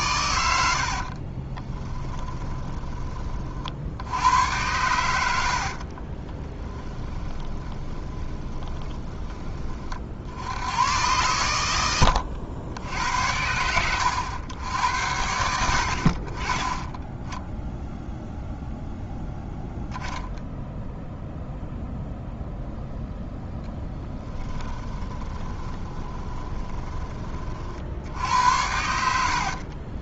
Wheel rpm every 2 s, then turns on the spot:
80, 20, 100, 20, 30, 80, 80, 90, 20, 0, 0, 0, 10, 20, 90.
0-4 6-10 24-28